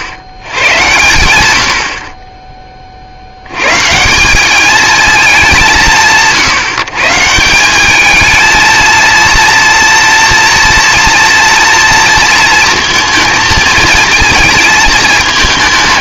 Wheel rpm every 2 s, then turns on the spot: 90, 20, 190, 140, 220, 230, 230, 220.
none